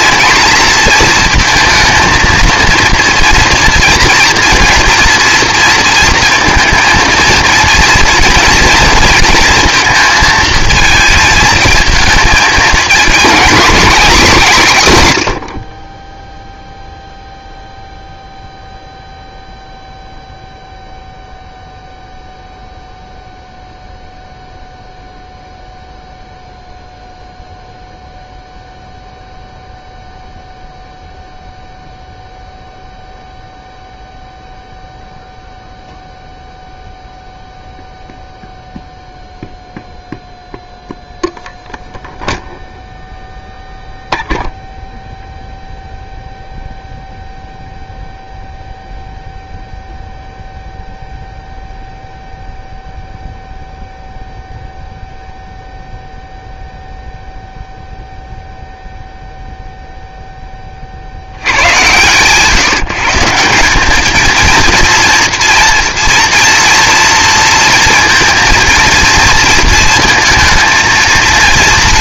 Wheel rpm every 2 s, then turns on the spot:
230, 230, 230, 230, 230, 220, 230, 180, 0, 0, 0, 0, 0, 0, 0, 0, 0, 0, 0, 0, 0, 0, 0, 0, 0, 0, 0, 0, 0, 0, 30, 160, 230, 240, 230, 220.
none